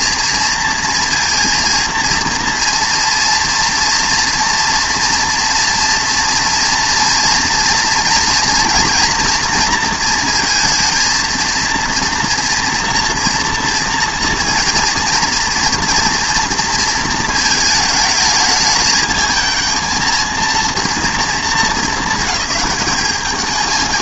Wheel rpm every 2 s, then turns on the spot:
230, 230, 230, 230, 230, 230, 240, 230, 230, 210, 230, 210.
none